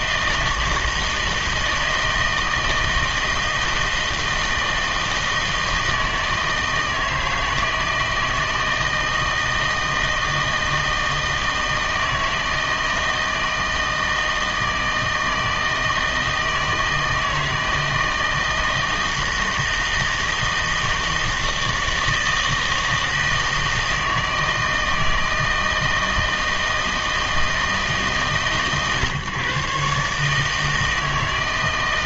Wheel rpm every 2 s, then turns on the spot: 160, 160, 160, 160, 160, 160, 160, 160, 160, 160, 160, 160, 160, 160, 130, 160.
none